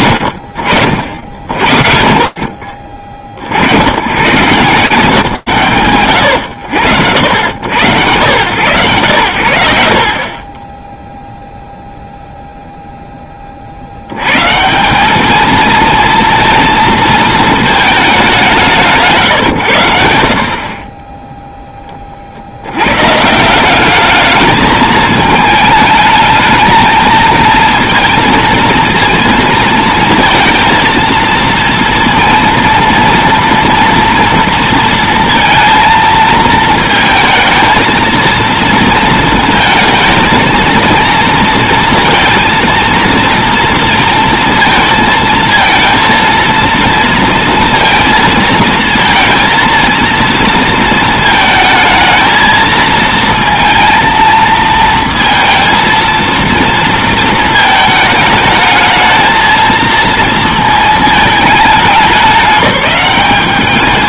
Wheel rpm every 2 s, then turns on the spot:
60, 110, 160, 90, 70, 0, 60, 230, 210, 80, 20, 190, 210, 230, 230, 230, 230, 230, 230, 220, 230, 230, 230, 230, 230, 220, 230, 230, 220, 220, 210, 180.
none